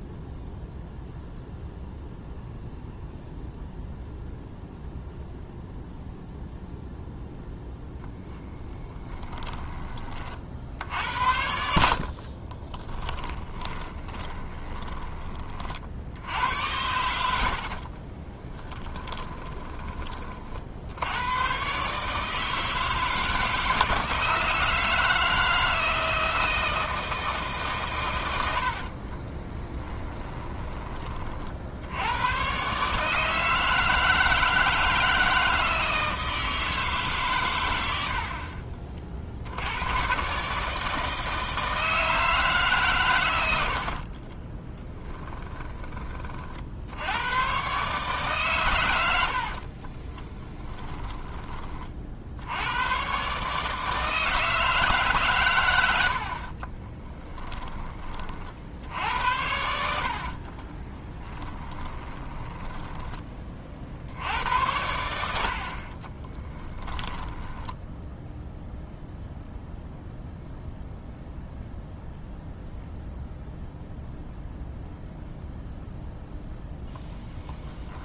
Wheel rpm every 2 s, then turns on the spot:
0, 0, 0, 0, 10, 60, 20, 20, 90, 20, 70, 160, 160, 160, 60, 20, 140, 160, 150, 40, 150, 140, 20, 70, 120, 20, 110, 150, 20, 70, 20, 10, 90, 20, 0, 0, 0, 0, 10.
8-10 12-16 18-20 28-30 44-46 50-52 56-58 60-64 66-68 76-78